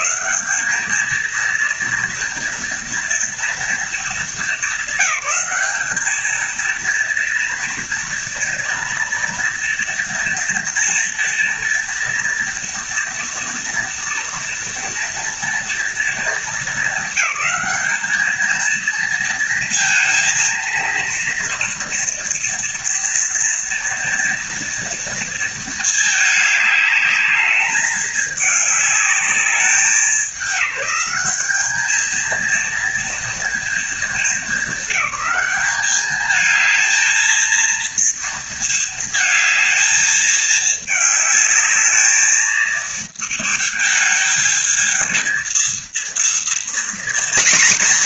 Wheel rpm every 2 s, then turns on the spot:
220, 230, 200, 230, 230, 230, 230, 240, 210, 220, 230, 230, 230, 210, 210, 200, 230, 210, 220, 220, 210, 220, 220, 240.
none